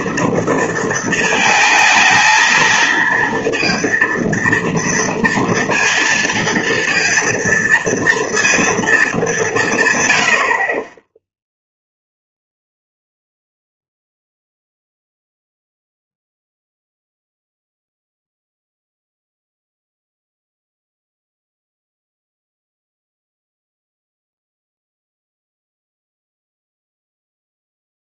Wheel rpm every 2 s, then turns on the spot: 230, 230, 230, 230, 230, 50, 0, 0, 0, 0, 0, 0, 0, 0.
none